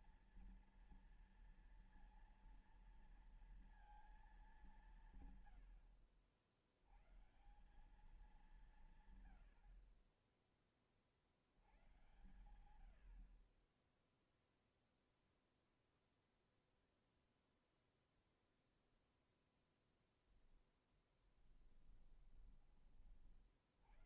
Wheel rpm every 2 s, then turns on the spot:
230, 230, 210, 80, 180, 30, 110, 0, 0, 0, 0, 20.
none